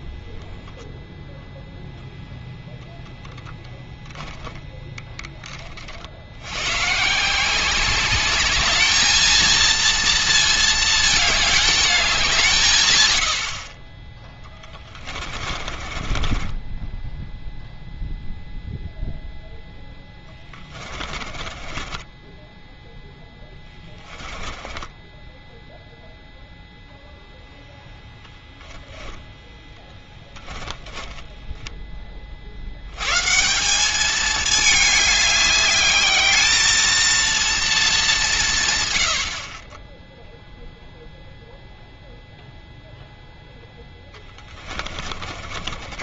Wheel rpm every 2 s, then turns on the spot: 0, 0, 10, 100, 210, 220, 140, 20, 20, 0, 20, 10, 10, 0, 10, 20, 80, 210, 220, 140, 0, 0, 30.
14-18 20-22 24-26 30-32 44-46